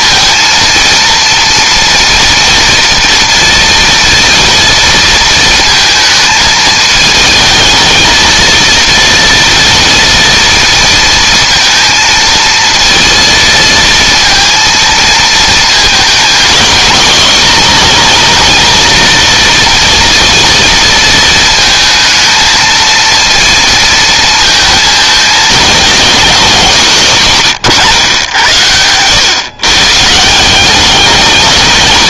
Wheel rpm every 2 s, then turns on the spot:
230, 230, 230, 220, 230, 230, 230, 230, 220, 230, 220, 230, 220, 170, 110, 210.
none